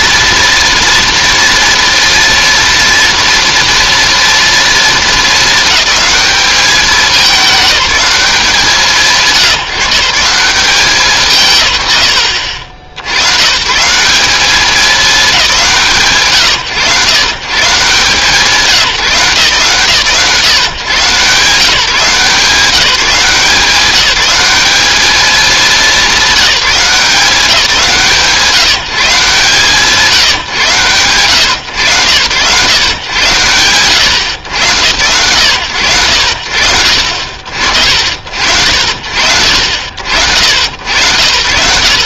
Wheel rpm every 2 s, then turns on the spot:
230, 230, 230, 210, 160, 190, 90, 210, 120, 160, 140, 180, 210, 180, 150, 140, 120, 90, 60, 60, 80.
none